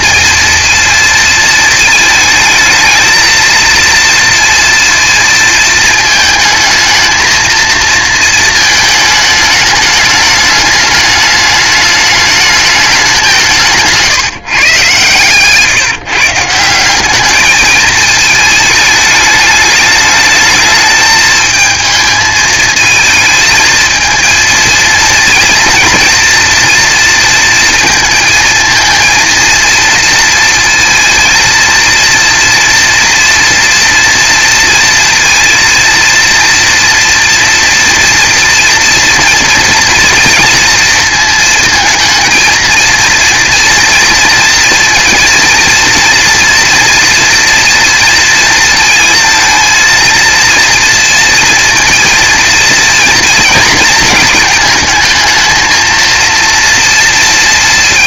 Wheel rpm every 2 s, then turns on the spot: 230, 220, 230, 220, 220, 210, 200, 140, 190, 210, 220, 220, 230, 230, 230, 230, 240, 230, 230, 230, 230, 230, 230, 230, 230, 230, 230, 230, 230.
none